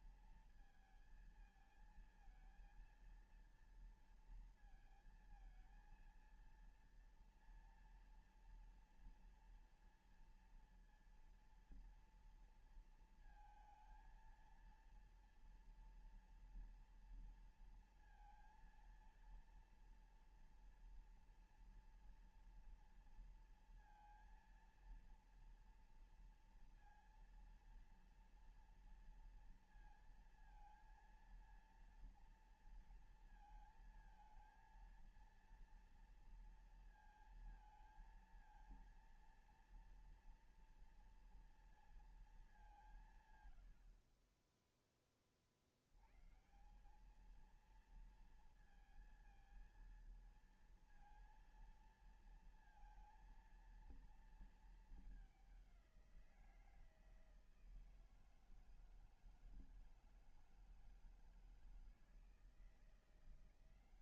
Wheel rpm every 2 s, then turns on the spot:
230, 220, 230, 230, 230, 230, 230, 230, 230, 230, 230, 230, 230, 230, 230, 230, 230, 230, 230, 230, 230, 220, 40, 110, 230, 230, 230, 230, 180, 160, 160, 160.
none